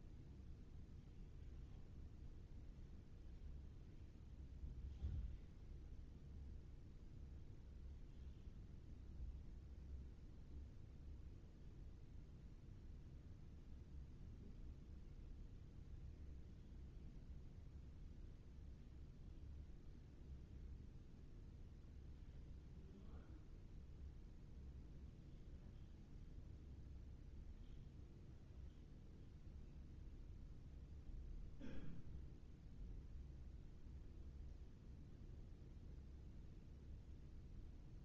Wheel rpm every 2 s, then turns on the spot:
0, 0, 0, 0, 0, 0, 0, 0, 0, 0, 0, 0, 0, 0, 0, 0, 0, 0, 0.
none